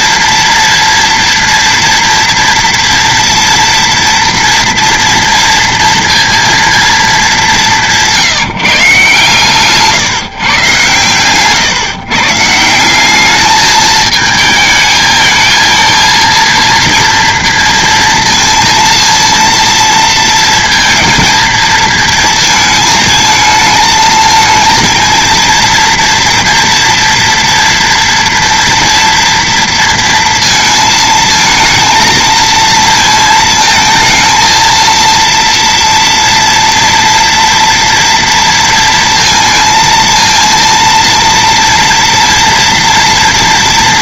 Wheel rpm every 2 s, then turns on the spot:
230, 230, 240, 230, 170, 140, 160, 220, 230, 230, 220, 220, 220, 230, 230, 230, 230, 230, 230, 230, 230, 230.
none